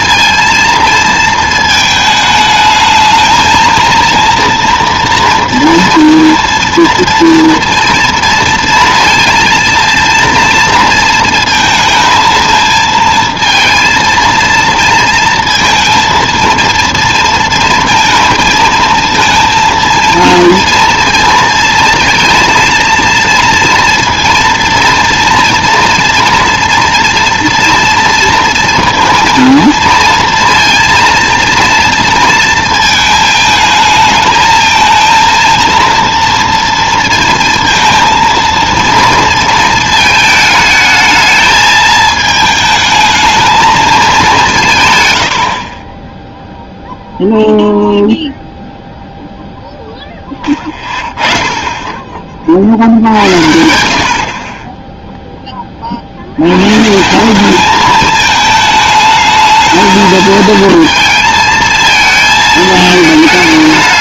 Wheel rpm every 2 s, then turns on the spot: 230, 220, 230, 230, 230, 230, 220, 230, 230, 230, 230, 230, 230, 230, 230, 230, 230, 220, 230, 230, 220, 220, 160, 0, 0, 10, 60, 20, 120, 220, 230, 220.
none